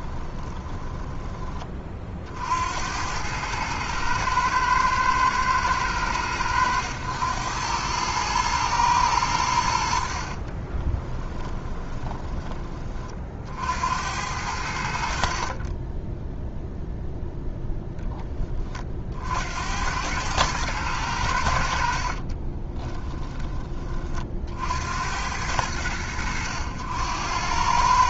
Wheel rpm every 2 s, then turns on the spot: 20, 80, 110, 100, 110, 20, 30, 70, 0, 40, 100, 20, 70, 80.
0-2 10-12 22-24